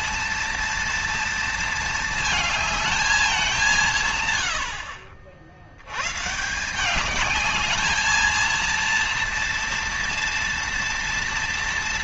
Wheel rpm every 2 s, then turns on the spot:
230, 220, 80, 170, 230, 240.
none